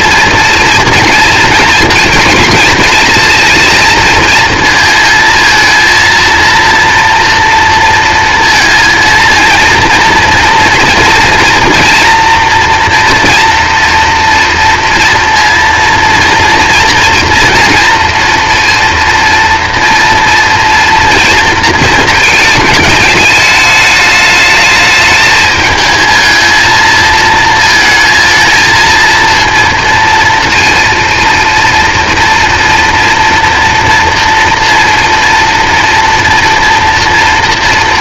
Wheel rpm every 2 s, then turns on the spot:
230, 220, 220, 230, 230, 230, 240, 230, 240, 230, 230, 220, 220, 220, 230, 230, 230, 230, 230.
none